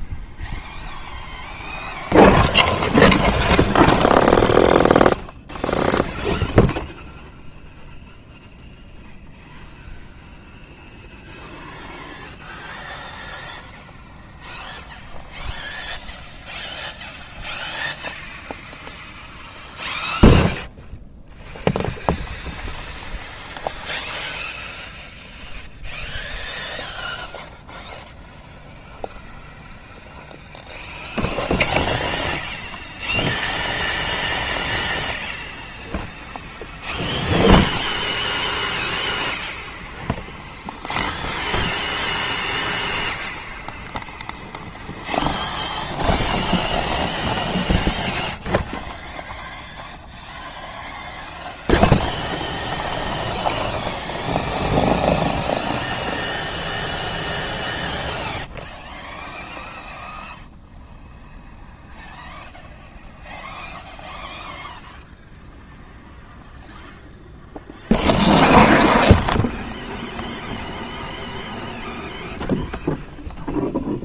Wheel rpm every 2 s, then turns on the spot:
0, 0, 0, 0, 0, 0, 0, 0, 0, 0, 0, 0, 0, 0, 0, 0, 0, 0, 0, 0, 0, 0, 0, 0, 0, 0, 0, 0, 0, 0, 0, 0, 0, 0, 0, 0, 0.
none